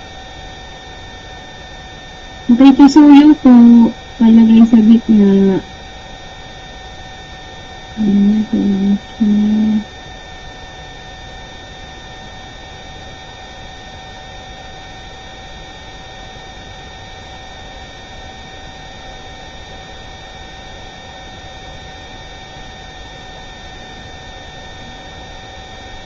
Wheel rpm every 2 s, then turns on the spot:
0, 0, 0, 0, 0, 0, 0, 0, 0, 0, 0, 0, 0.
none